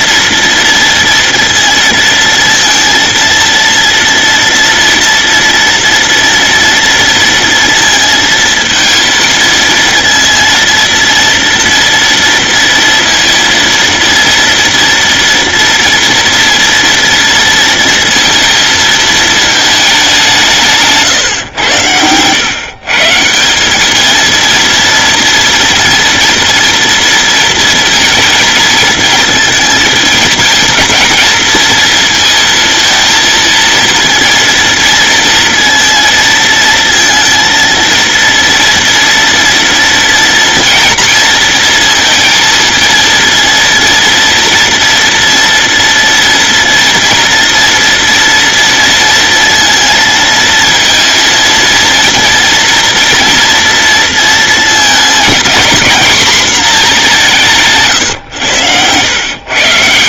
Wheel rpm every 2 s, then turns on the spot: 230, 230, 230, 230, 230, 230, 230, 230, 230, 230, 150, 140, 230, 230, 220, 230, 230, 230, 230, 230, 230, 230, 230, 230, 230, 230, 240, 230, 220, 100.
58-60